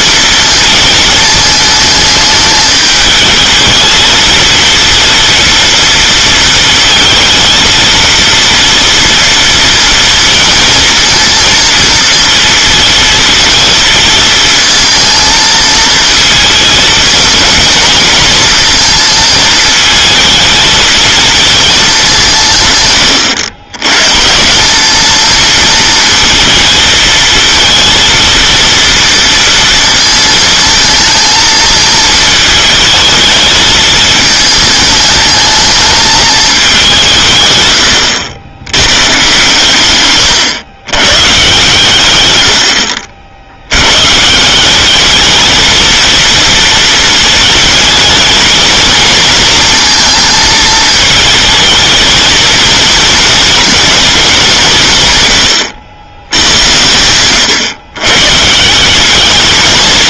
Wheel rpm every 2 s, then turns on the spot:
220, 220, 220, 230, 230, 230, 230, 220, 230, 230, 220, 150, 180, 220, 230, 230, 220, 220, 210, 110, 110, 110, 180, 220, 220, 220, 220, 180, 90, 160.
none